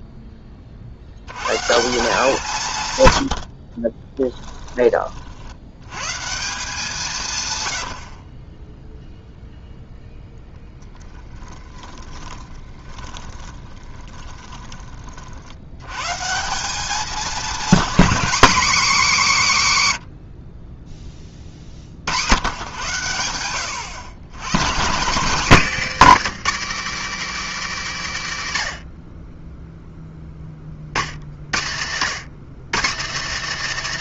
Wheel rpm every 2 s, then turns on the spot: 70, 140, 40, 170, 0, 10, 20, 40, 210, 260, 30, 110, 170, 300, 60, 40, 230.
10-14